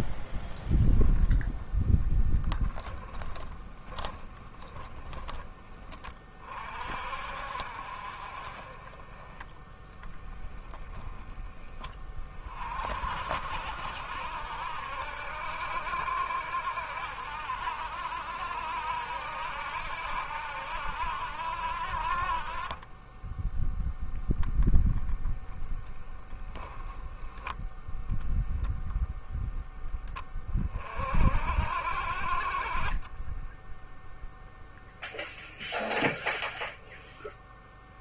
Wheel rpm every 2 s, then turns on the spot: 0, 10, 10, 40, 30, 10, 40, 70, 70, 70, 70, 30, 0, 10, 0, 30, 30, 0, 0.
4-6